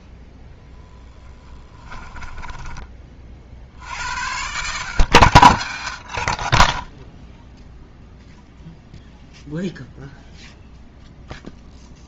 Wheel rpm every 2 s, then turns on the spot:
0, 20, 100, 40, 0, 0.
2-4